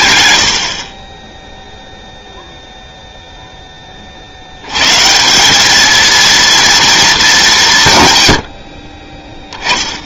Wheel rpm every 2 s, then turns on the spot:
90, 0, 90, 230, 90.
8-10